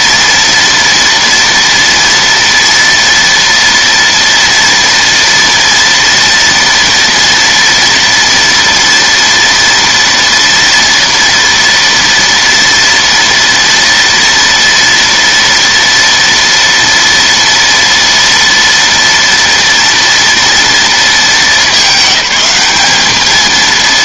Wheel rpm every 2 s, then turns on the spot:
230, 230, 230, 230, 230, 230, 230, 230, 230, 230, 220, 210.
none